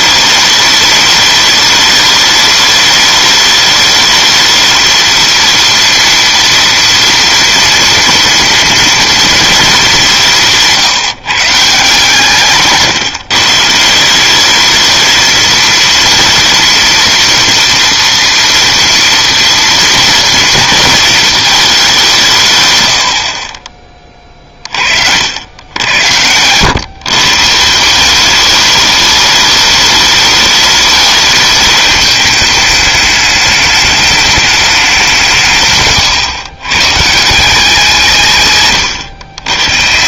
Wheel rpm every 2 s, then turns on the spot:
210, 210, 220, 230, 230, 170, 150, 210, 230, 230, 230, 110, 40, 110, 210, 210, 210, 200, 120, 130.
12-14